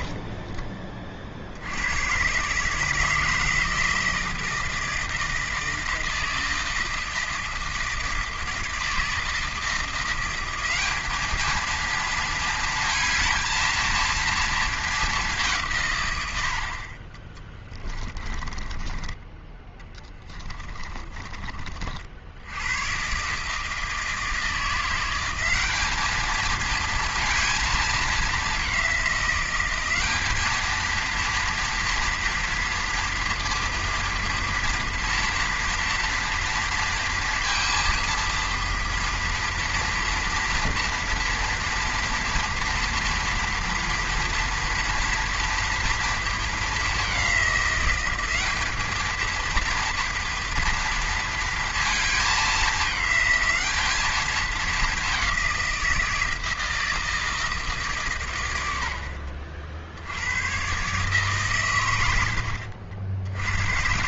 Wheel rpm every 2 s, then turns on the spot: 30, 150, 160, 160, 160, 190, 230, 220, 60, 20, 20, 100, 170, 220, 200, 220, 230, 230, 230, 230, 240, 230, 230, 220, 210, 230, 210, 210, 160, 100, 120, 80.
0-2 18-22 62-64